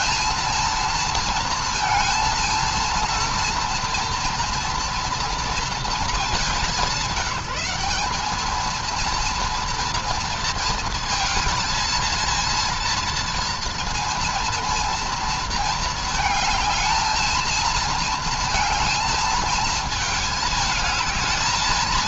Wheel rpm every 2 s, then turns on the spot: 230, 230, 230, 190, 230, 230, 230, 230, 220, 220, 220.
none